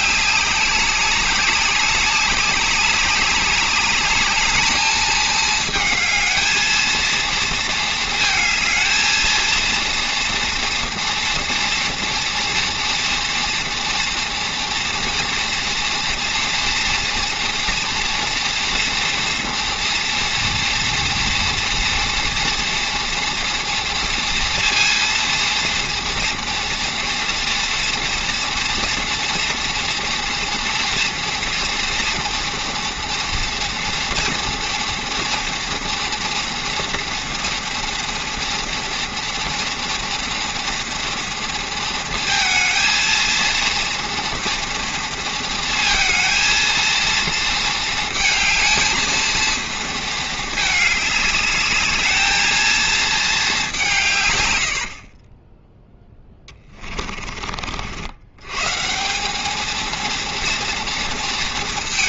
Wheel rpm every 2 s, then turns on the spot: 200, 200, 210, 220, 220, 230, 230, 230, 240, 230, 230, 230, 230, 230, 230, 230, 230, 230, 230, 230, 240, 220, 230, 230, 220, 210, 230, 90, 20, 130, 230.
56-58